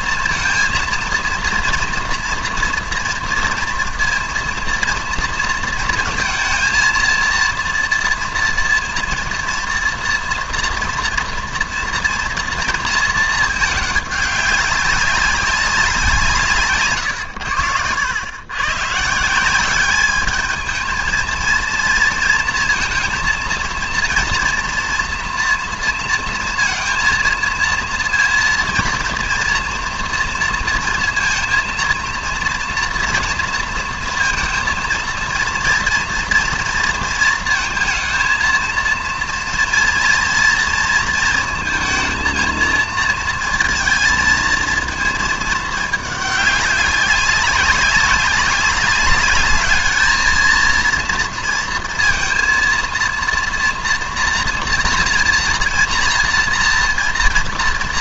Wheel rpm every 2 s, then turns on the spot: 230, 230, 240, 230, 230, 240, 230, 200, 150, 120, 220, 230, 230, 230, 230, 230, 230, 230, 230, 230, 230, 230, 220, 200, 200, 230, 230, 230, 240.
none